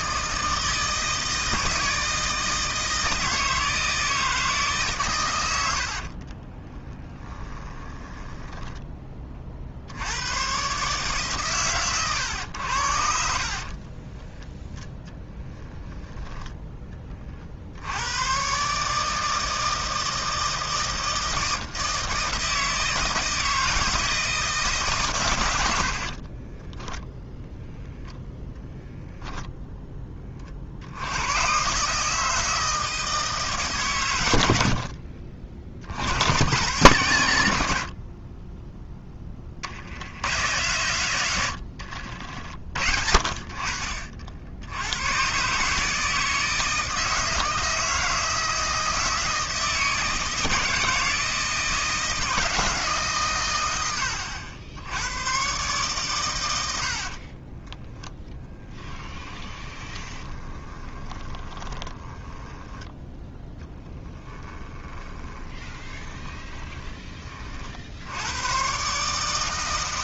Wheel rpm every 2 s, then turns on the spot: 160, 160, 140, 10, 10, 140, 70, 10, 10, 150, 160, 160, 140, 10, 0, 70, 160, 60, 130, 10, 120, 60, 100, 160, 160, 160, 150, 90, 70, 10, 20, 10, 20, 30, 130.
6-8 26-28 34-36 56-62 64-68